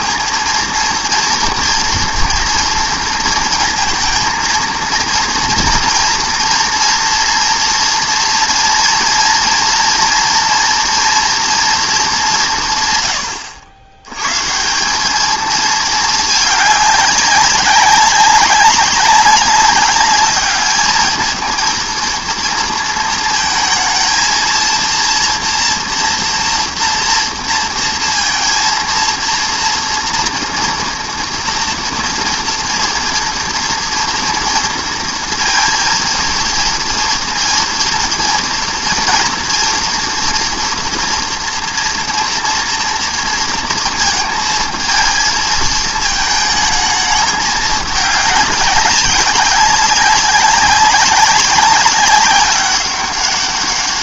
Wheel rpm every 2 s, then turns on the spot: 230, 230, 230, 230, 230, 230, 150, 160, 200, 200, 210, 230, 230, 230, 230, 230, 230, 230, 230, 230, 230, 230, 230, 220, 200, 190, 200.
none